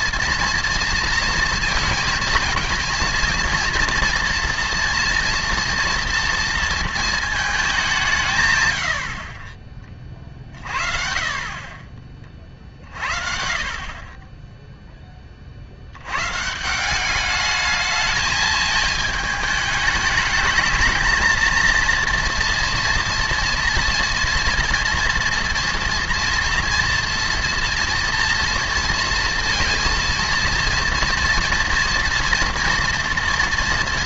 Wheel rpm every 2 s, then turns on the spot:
230, 230, 230, 230, 110, 40, 40, 0, 160, 220, 210, 230, 230, 230, 230, 230, 230.
none